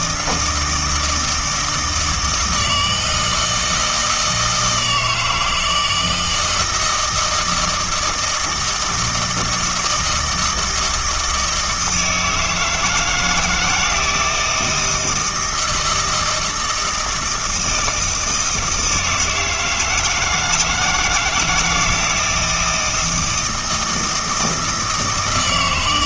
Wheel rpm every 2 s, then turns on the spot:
160, 160, 160, 160, 160, 160, 160, 160, 160, 160, 170, 170, 160.
none